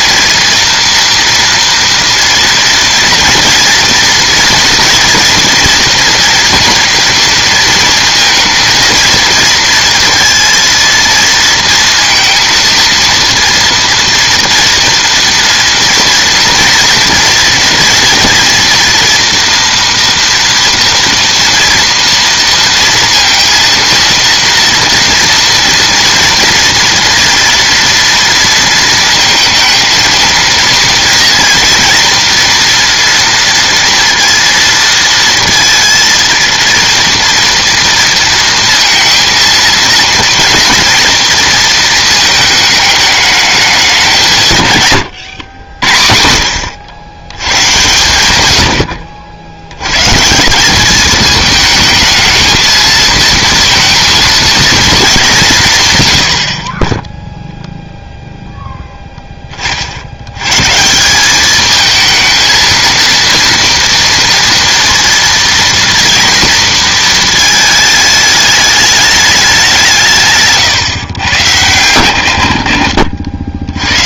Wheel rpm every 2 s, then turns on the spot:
230, 230, 230, 230, 230, 230, 230, 230, 230, 230, 230, 230, 230, 230, 230, 230, 230, 230, 230, 230, 230, 220, 160, 70, 100, 180, 220, 220, 60, 0, 130, 230, 230, 230, 210, 140, 80.
none